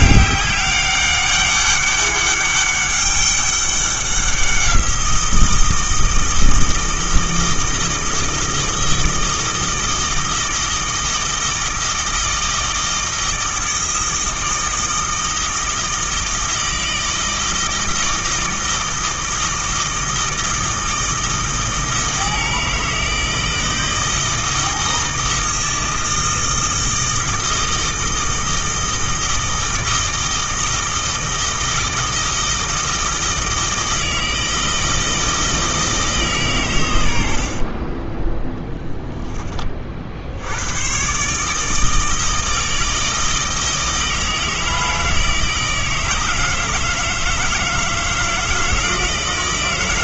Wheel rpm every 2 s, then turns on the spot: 200, 200, 180, 160, 160, 160, 160, 160, 160, 160, 160, 160, 160, 160, 160, 160, 160, 160, 130, 10, 100, 160, 160, 160, 160.
none